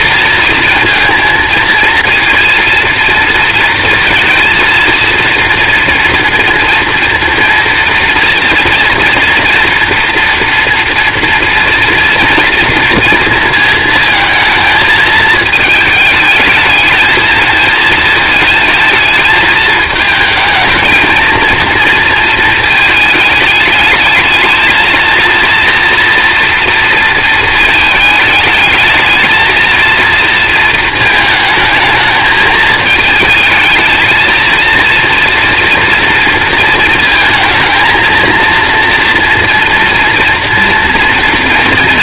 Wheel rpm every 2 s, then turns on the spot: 230, 230, 230, 230, 230, 230, 230, 220, 220, 220, 230, 220, 220, 230, 220, 220, 220, 230, 230, 230, 230.
none